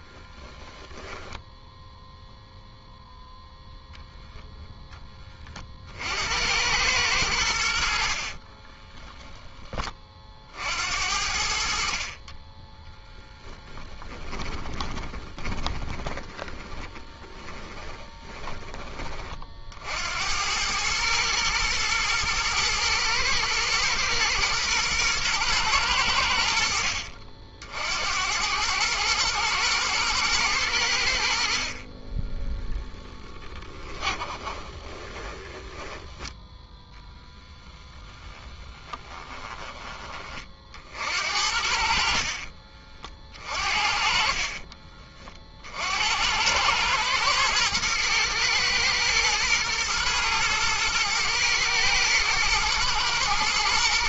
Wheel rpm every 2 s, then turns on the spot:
10, 0, 10, 100, 20, 60, 20, 20, 30, 20, 100, 110, 120, 70, 110, 90, 0, 20, 10, 10, 50, 40, 40, 100, 110, 110, 110.
0-2 8-10 12-18 34-36 38-40 44-46